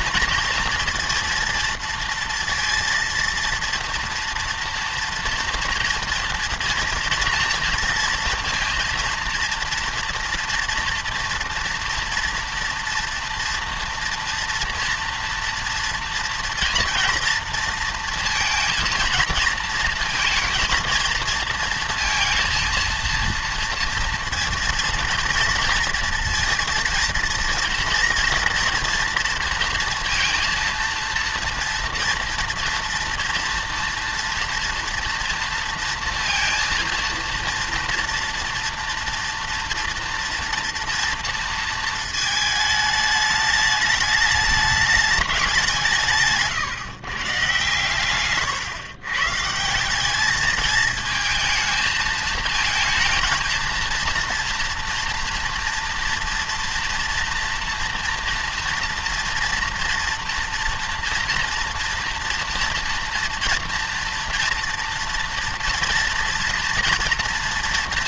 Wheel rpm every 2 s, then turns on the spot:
230, 230, 230, 230, 230, 230, 230, 230, 230, 230, 230, 230, 230, 230, 230, 230, 230, 230, 230, 230, 230, 220, 210, 150, 120, 220, 220, 230, 230, 230, 230, 240, 240, 230.
none